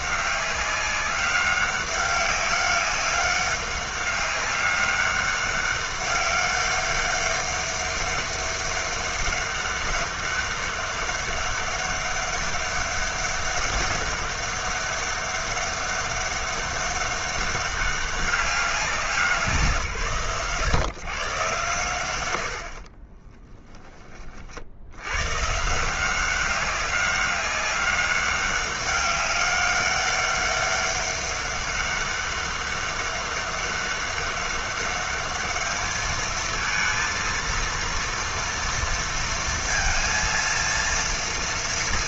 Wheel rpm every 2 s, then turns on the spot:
200, 200, 200, 200, 200, 200, 200, 200, 200, 190, 120, 70, 60, 190, 200, 200, 200, 200, 230, 230, 230.
none